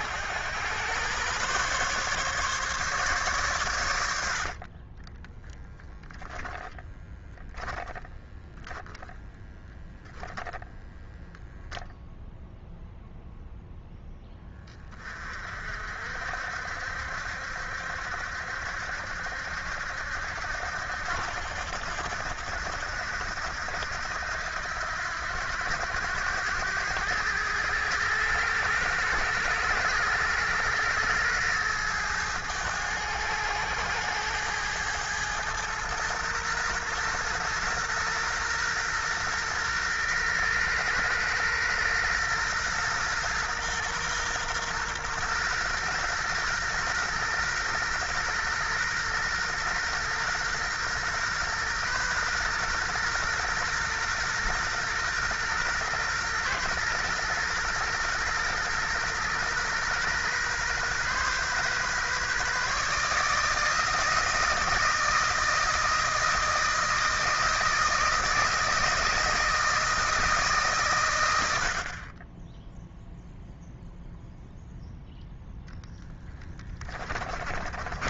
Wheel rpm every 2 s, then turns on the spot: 110, 140, 40, 10, 10, 0, 0, 20, 70, 70, 80, 80, 80, 100, 110, 110, 100, 110, 120, 120, 120, 120, 120, 120, 120, 120, 120, 120, 120, 120, 130, 150, 160, 160, 160, 130, 0, 0, 20.
4-10 76-78